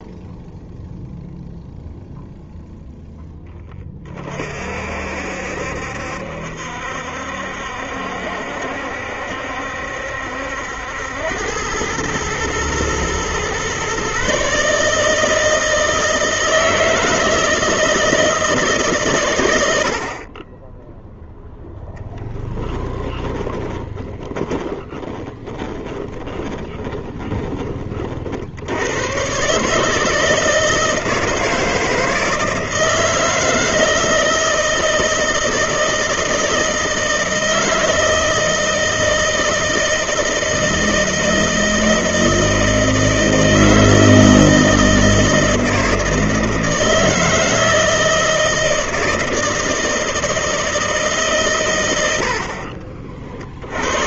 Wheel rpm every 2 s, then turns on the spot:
0, 10, 60, 70, 70, 80, 120, 150, 160, 140, 10, 10, 20, 20, 100, 160, 160, 160, 160, 160, 160, 160, 160, 160, 160, 160, 50.
22-28